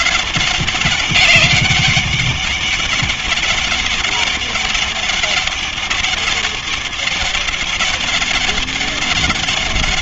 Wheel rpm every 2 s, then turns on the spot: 190, 190, 190, 200, 200.
none